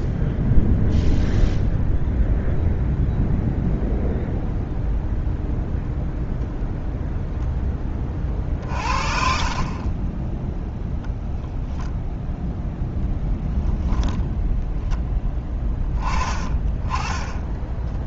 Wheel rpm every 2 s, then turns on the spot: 0, 0, 0, 0, 40, 0, 0, 10, 20.
none